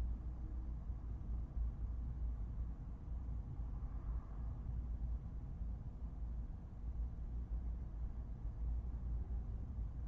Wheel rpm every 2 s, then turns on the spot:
0, 0, 0, 0, 0.
none